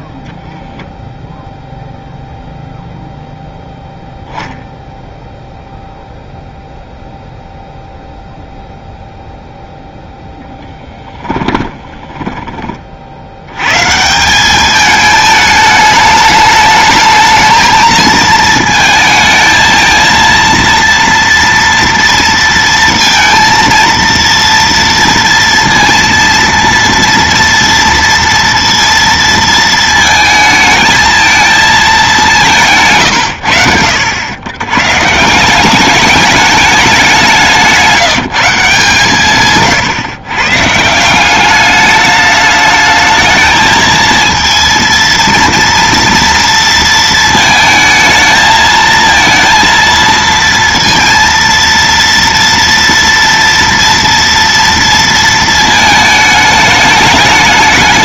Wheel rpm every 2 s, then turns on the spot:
0, 0, 0, 0, 0, 10, 130, 210, 220, 220, 230, 230, 230, 230, 220, 220, 80, 190, 170, 140, 200, 220, 230, 220, 230, 230, 230, 220, 210.
10-12